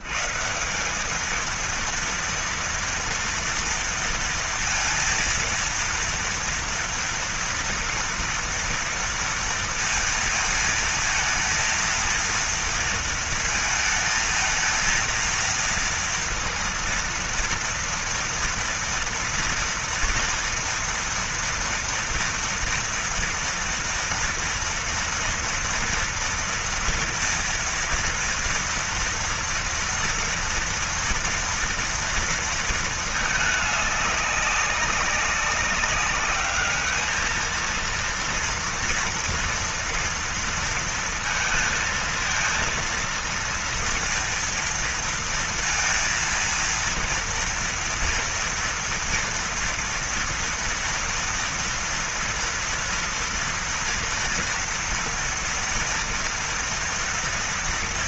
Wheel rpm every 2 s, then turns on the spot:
110, 230, 230, 230, 230, 230, 230, 220, 230, 230, 240, 240, 230, 240, 230, 230, 230, 200, 200, 230, 230, 230, 230, 230, 230, 230, 230, 240, 230.
none